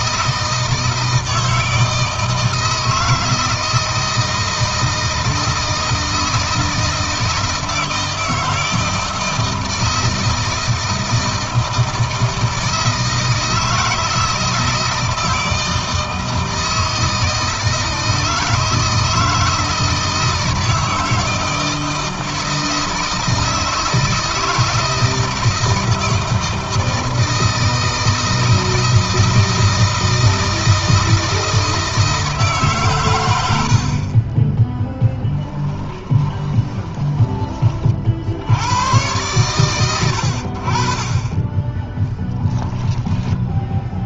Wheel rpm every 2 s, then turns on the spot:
160, 160, 160, 160, 160, 160, 160, 160, 160, 160, 160, 160, 160, 160, 160, 160, 130, 10, 20, 90, 40, 10.
34-38 42-44